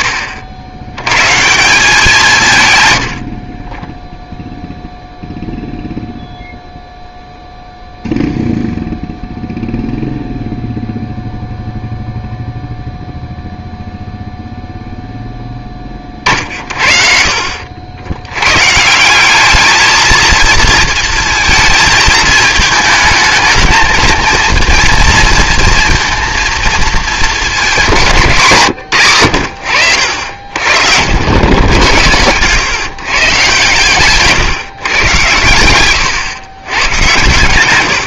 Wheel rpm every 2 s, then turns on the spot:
90, 140, 0, 0, 0, 0, 0, 0, 50, 120, 230, 220, 230, 230, 160, 60, 120, 140, 110.
none